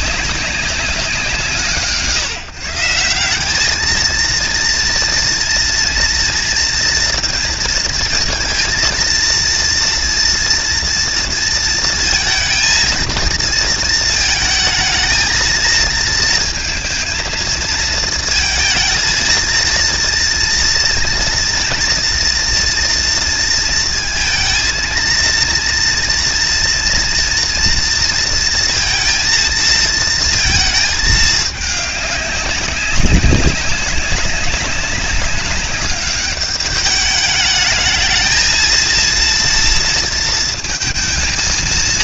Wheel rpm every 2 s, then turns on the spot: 170, 180, 230, 230, 230, 230, 230, 220, 230, 220, 230, 230, 230, 230, 230, 220, 190, 200, 210, 230, 230.
none